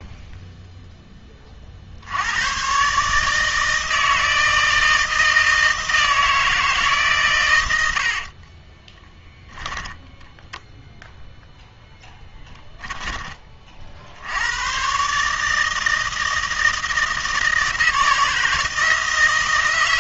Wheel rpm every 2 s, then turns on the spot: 0, 120, 160, 160, 30, 0, 10, 120, 160, 150.
8-10